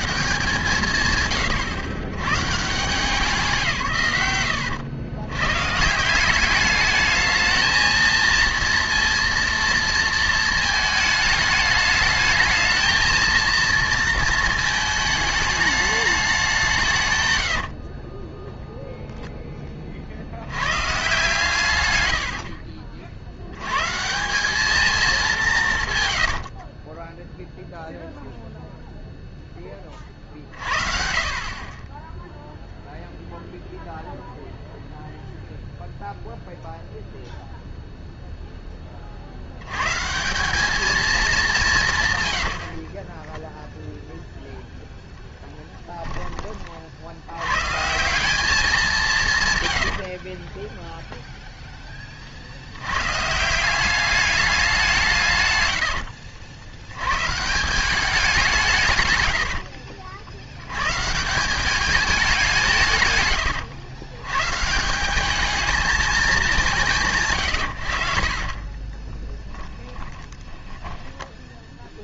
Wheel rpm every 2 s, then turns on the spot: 170, 150, 100, 210, 230, 220, 220, 220, 160, 0, 100, 50, 210, 40, 0, 50, 0, 0, 0, 20, 210, 50, 0, 60, 200, 10, 70, 180, 100, 150, 110, 150, 160, 140, 20, 10.
26-28 42-44 50-52 68-72